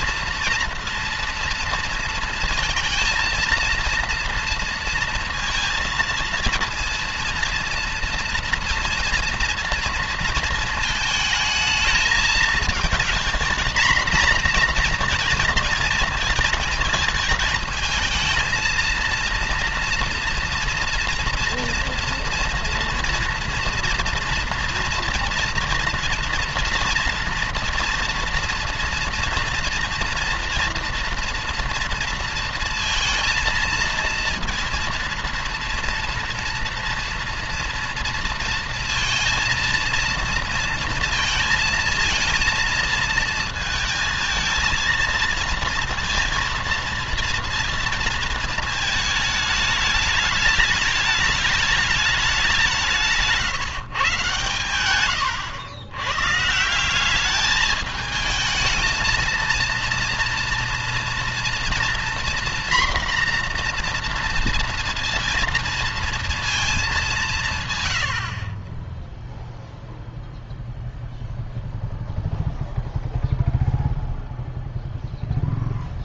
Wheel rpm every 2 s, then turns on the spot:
230, 230, 230, 230, 230, 230, 220, 240, 220, 230, 230, 230, 240, 240, 240, 230, 230, 230, 230, 230, 230, 230, 230, 230, 220, 210, 170, 110, 180, 220, 230, 240, 230, 200, 20, 0, 0, 0.
54-56